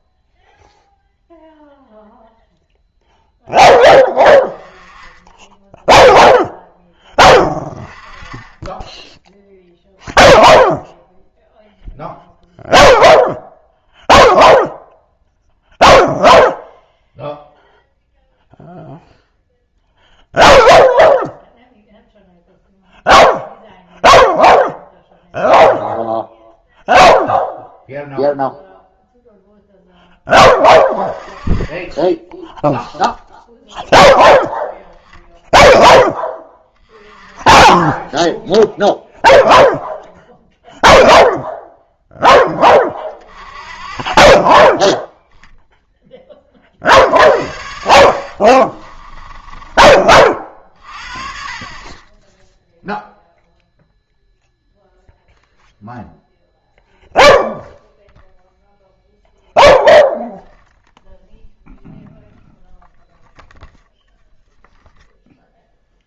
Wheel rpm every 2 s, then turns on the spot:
0, 0, 10, 10, 10, 0, 0, 0, 0, 0, 0, 0, 0, 0, 0, 20, 0, 0, 20, 0, 0, 30, 20, 40, 30, 40, 0, 0, 0, 0, 0, 0, 0.
48-50